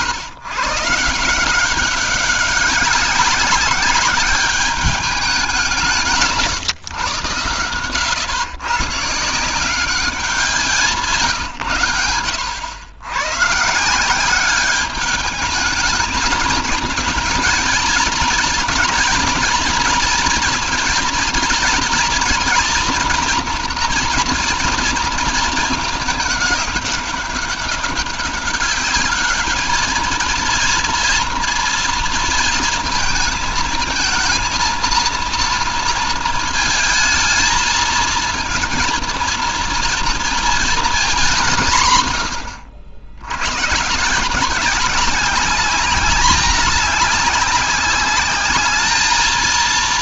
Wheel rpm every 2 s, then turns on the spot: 140, 190, 200, 120, 120, 180, 90, 200, 230, 230, 230, 230, 230, 200, 200, 230, 230, 230, 220, 230, 220, 100, 180, 200, 210.
none